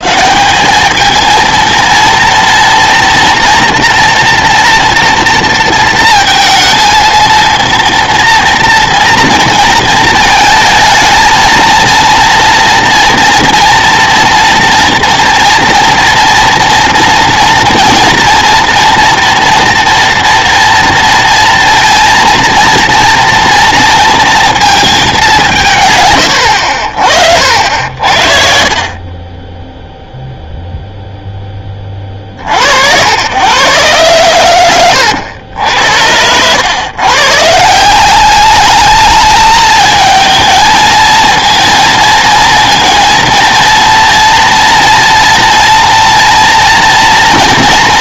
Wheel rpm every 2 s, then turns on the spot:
200, 230, 230, 230, 230, 220, 230, 230, 240, 230, 230, 230, 230, 80, 60, 0, 80, 110, 100, 210, 220, 230, 230, 240.
none